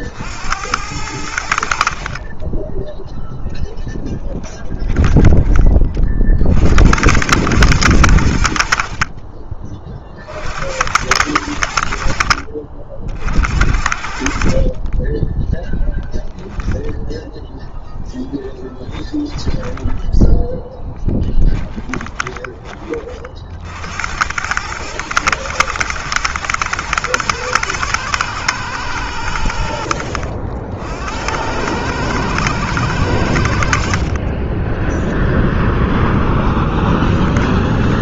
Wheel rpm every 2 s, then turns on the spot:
80, 10, 20, 90, 50, 80, 70, 30, 10, 10, 10, 30, 110, 120, 100, 80, 100, 10, 10.
4-6 18-22 36-38